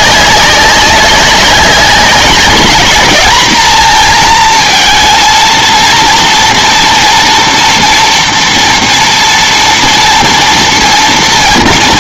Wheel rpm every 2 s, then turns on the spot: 190, 200, 230, 230, 230, 230.
none